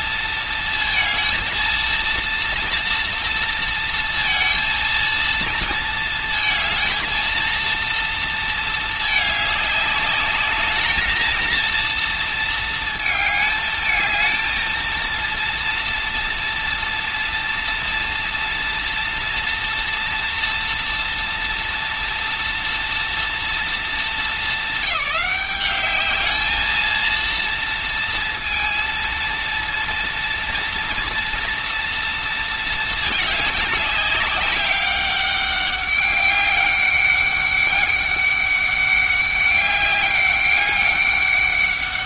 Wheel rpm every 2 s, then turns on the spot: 230, 230, 230, 220, 220, 210, 220, 230, 230, 230, 240, 230, 200, 220, 230, 230, 220, 200, 200, 200, 200.
none